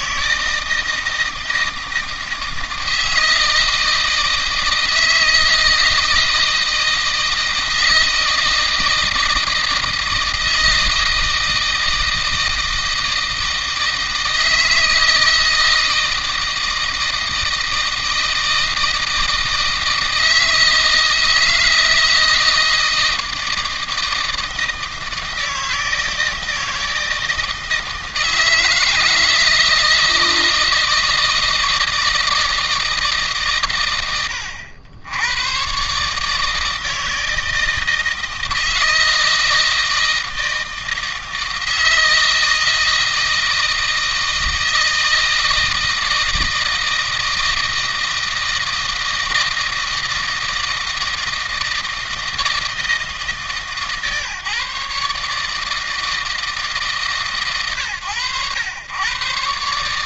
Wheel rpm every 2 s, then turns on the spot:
160, 160, 160, 160, 160, 160, 160, 160, 160, 160, 160, 160, 160, 160, 160, 160, 160, 90, 150, 160, 160, 160, 160, 160, 160, 160, 160, 140, 160, 110.
none